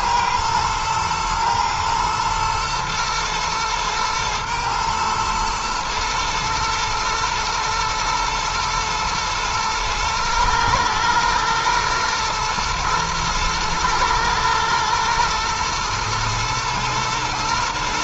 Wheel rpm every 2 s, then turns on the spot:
110, 120, 110, 110, 110, 110, 110, 110, 110.
none